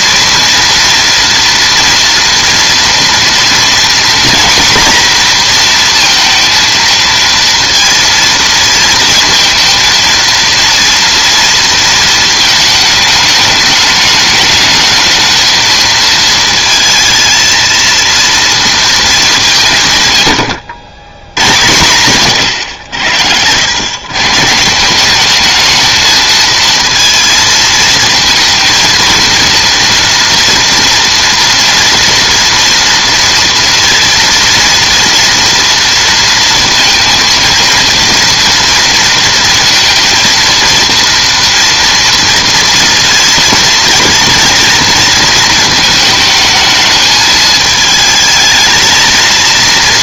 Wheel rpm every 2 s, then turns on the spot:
230, 230, 240, 230, 230, 230, 220, 220, 230, 230, 90, 110, 160, 220, 230, 240, 230, 230, 230, 230, 230, 230, 230, 220, 220.
22-24